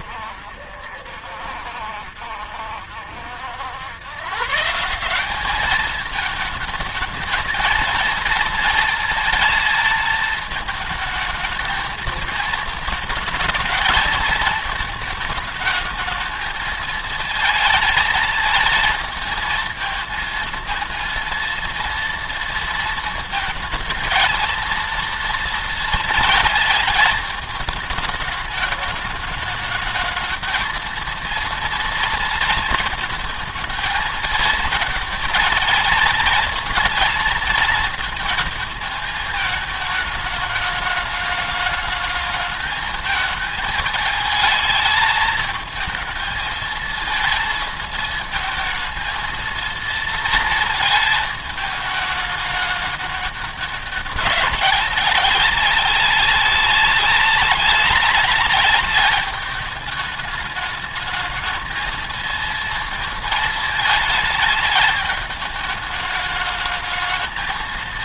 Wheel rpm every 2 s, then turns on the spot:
70, 70, 140, 220, 230, 220, 220, 220, 220, 220, 230, 230, 230, 220, 210, 230, 230, 220, 230, 220, 210, 210, 220, 220, 220, 230, 210, 200, 200, 210, 210, 230, 220, 220.
none